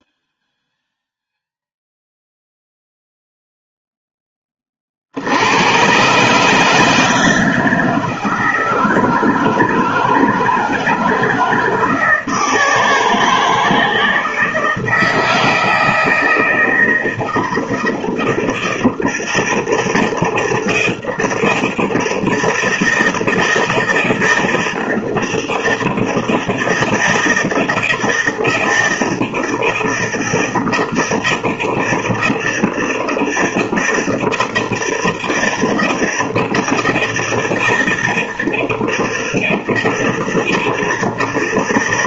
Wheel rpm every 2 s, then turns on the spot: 0, 0, 40, 160, 160, 170, 160, 160, 160, 160, 160, 160, 160, 160, 160, 160, 160, 160, 160, 160, 160.
none